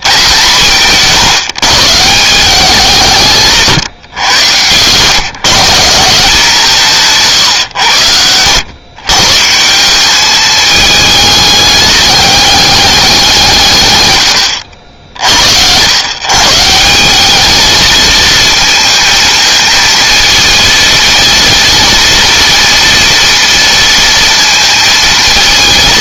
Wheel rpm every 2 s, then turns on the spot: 150, 180, 120, 180, 120, 210, 200, 60, 170, 230, 230, 230, 230.
none